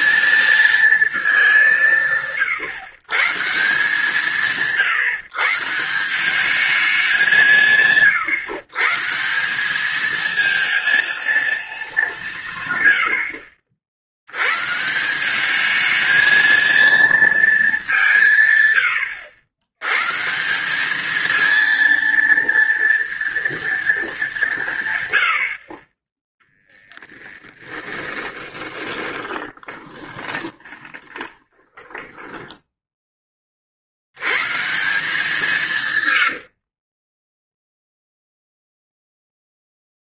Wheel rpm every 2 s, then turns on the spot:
220, 130, 140, 200, 150, 230, 140, 120, 220, 120, 180, 230, 170, 10, 20, 20, 10, 140, 60, 0.
28-34 36-38